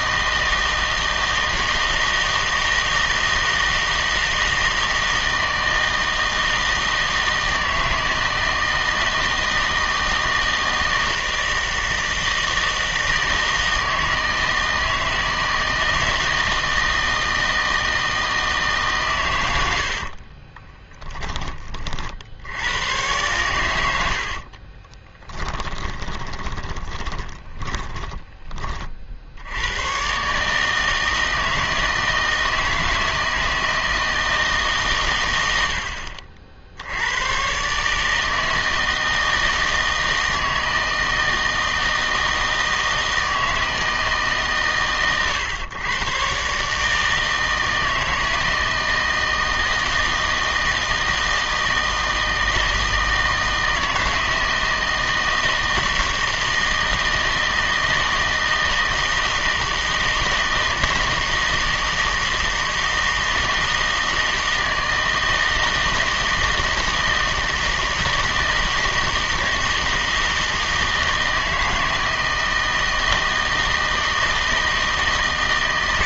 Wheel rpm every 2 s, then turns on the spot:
160, 160, 160, 160, 160, 160, 160, 160, 160, 150, 20, 90, 40, 20, 30, 150, 160, 150, 70, 160, 160, 160, 140, 140, 160, 160, 160, 160, 160, 160, 160, 160, 160, 160, 160, 160, 160, 160.
20-22 24-28